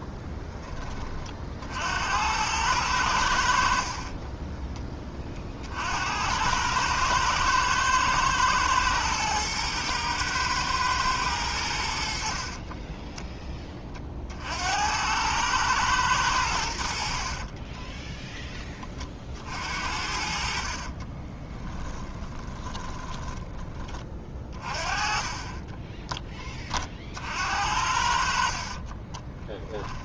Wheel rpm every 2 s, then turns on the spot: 20, 90, 20, 100, 110, 110, 20, 90, 60, 20, 40, 20, 30, 40, 30.
12-14 20-26 28-30